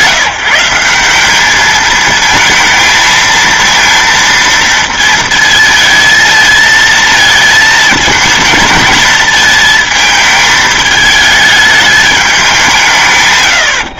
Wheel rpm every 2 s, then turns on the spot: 180, 220, 230, 220, 220, 220, 190.
none